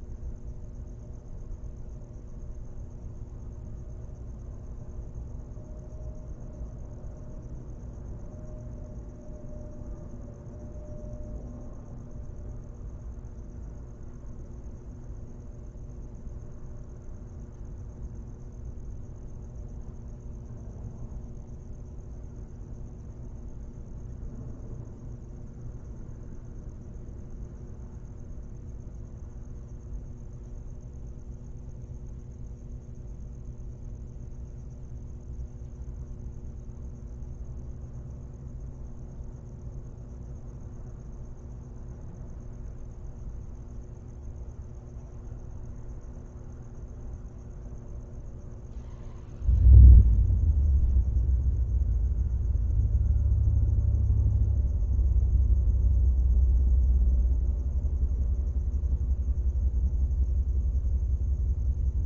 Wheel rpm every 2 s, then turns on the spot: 0, 0, 0, 0, 0, 0, 0, 0, 0, 0, 0, 0, 0, 0, 0, 0, 0, 0, 0, 0, 0, 0, 0, 0, 0, 0, 0, 0, 0, 0, 0.
none